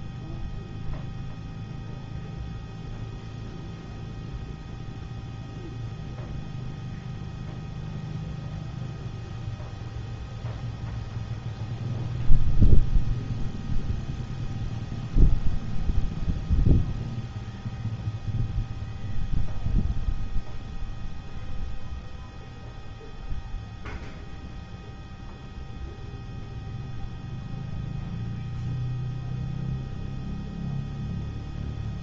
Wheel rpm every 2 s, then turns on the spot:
0, 0, 0, 0, 0, 0, 0, 0, 0, 0, 0, 0, 0, 0, 0, 0.
none